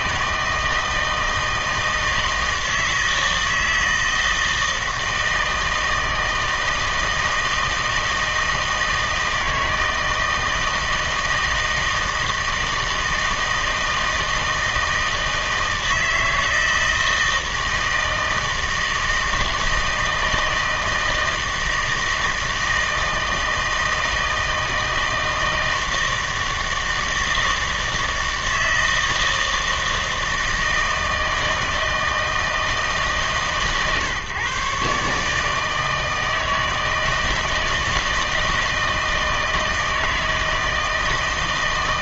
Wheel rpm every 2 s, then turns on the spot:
160, 160, 160, 160, 160, 160, 160, 160, 160, 160, 160, 160, 160, 160, 160, 160, 160, 130, 160, 160, 160.
none